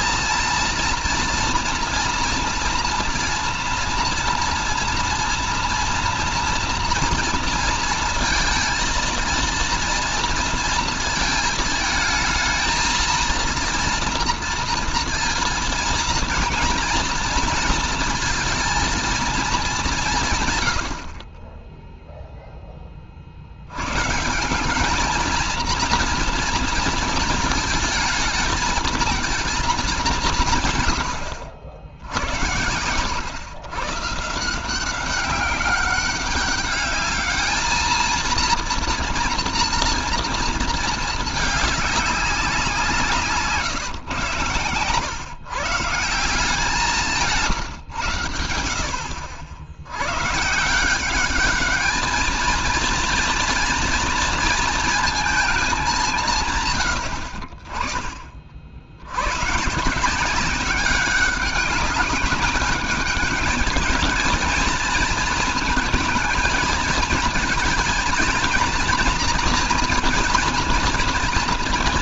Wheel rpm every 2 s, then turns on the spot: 230, 230, 230, 230, 230, 230, 220, 230, 230, 230, 120, 10, 190, 230, 230, 160, 80, 170, 200, 230, 230, 180, 130, 170, 80, 160, 230, 230, 120, 50, 190, 210, 230, 230, 230, 230.
44-46